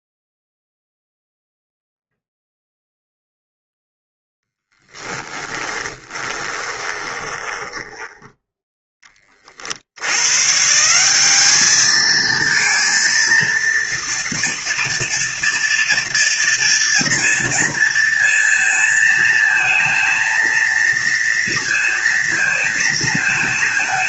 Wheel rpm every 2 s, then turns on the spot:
0, 0, 10, 20, 20, 180, 230, 230, 230, 230, 230, 210.
4-8